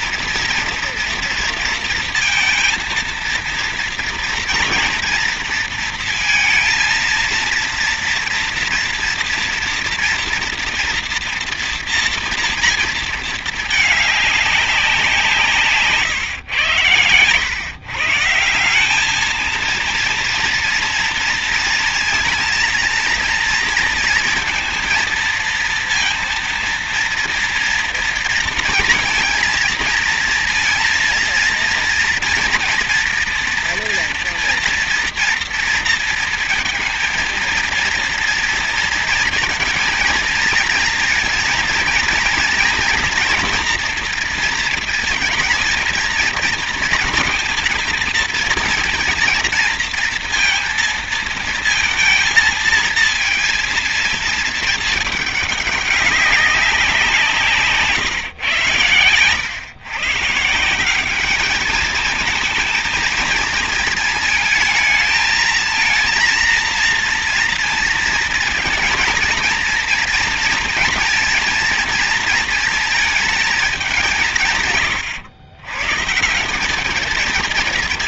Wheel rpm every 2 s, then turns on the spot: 240, 230, 230, 230, 230, 230, 230, 190, 120, 200, 230, 230, 230, 230, 230, 230, 230, 240, 230, 230, 230, 240, 230, 220, 230, 230, 230, 220, 170, 100, 200, 220, 220, 230, 230, 230, 220, 140, 200.
none